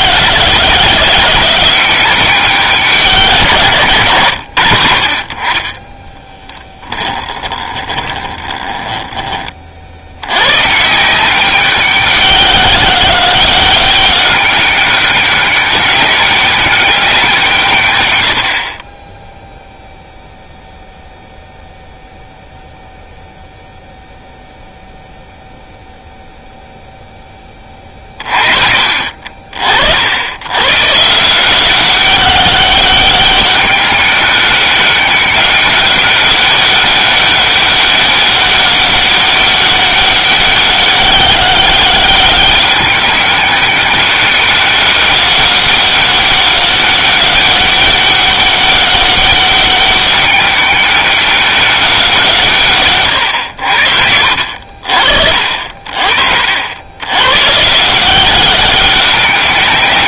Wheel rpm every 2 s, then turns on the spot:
180, 180, 80, 20, 20, 120, 190, 200, 200, 50, 0, 0, 0, 0, 50, 120, 190, 200, 200, 200, 190, 200, 200, 200, 200, 200, 140, 60, 80, 200.
6-10